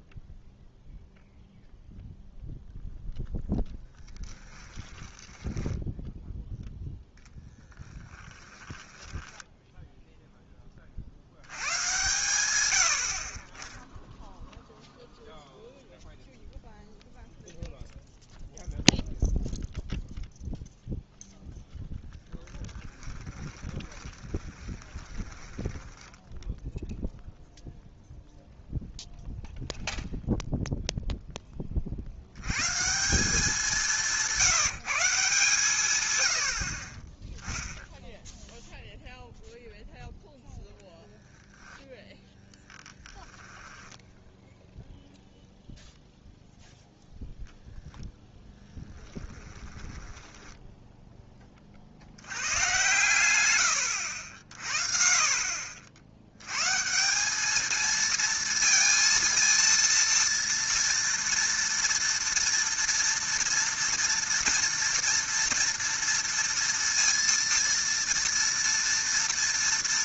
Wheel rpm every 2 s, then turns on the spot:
0, 0, 10, 0, 10, 20, 90, 0, 0, 0, 0, 10, 20, 0, 0, 0, 130, 170, 60, 0, 0, 10, 0, 0, 10, 10, 110, 50, 110, 230, 230, 230, 230, 230, 230.
4-6 8-10 24-26 42-44 48-52 54-56